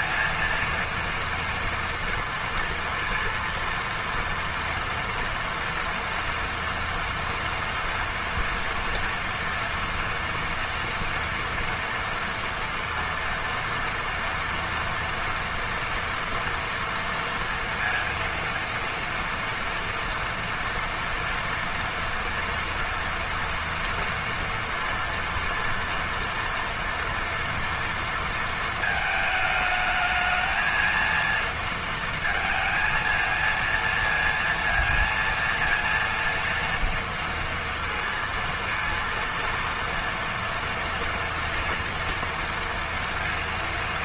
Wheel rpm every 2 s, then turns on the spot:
230, 230, 240, 230, 230, 230, 230, 230, 240, 230, 230, 230, 230, 230, 220, 230, 230, 230, 230, 230, 240, 230.
none